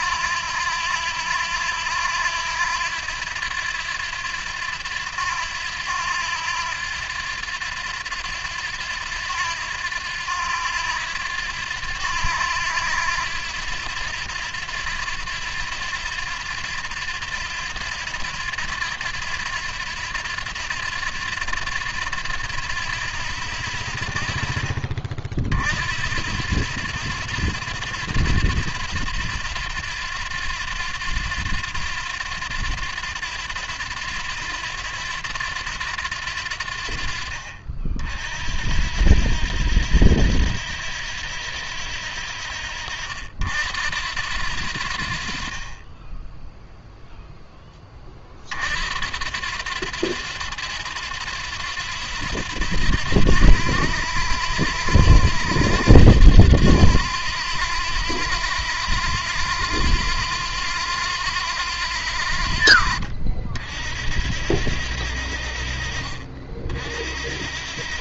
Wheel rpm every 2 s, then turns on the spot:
90, 90, 90, 90, 90, 90, 90, 90, 90, 90, 90, 90, 50, 90, 90, 90, 90, 90, 60, 70, 90, 70, 60, 0, 60, 90, 80, 80, 90, 90, 90, 60, 80, 60.
62-64